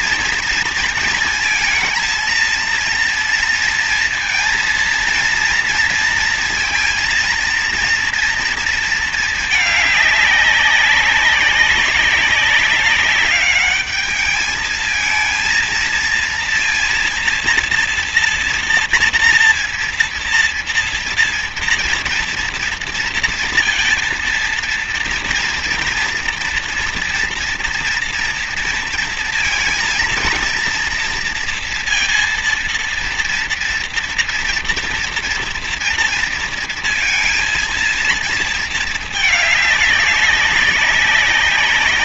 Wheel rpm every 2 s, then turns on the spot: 230, 230, 230, 230, 230, 190, 190, 220, 230, 230, 230, 230, 230, 230, 230, 230, 230, 230, 230, 220, 190.
none